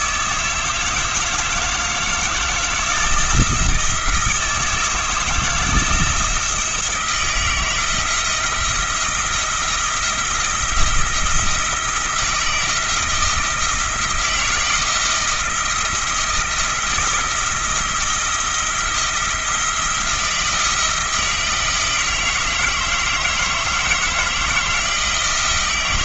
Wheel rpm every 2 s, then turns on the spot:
160, 170, 160, 160, 170, 170, 160, 160, 160, 170, 170, 160, 170.
none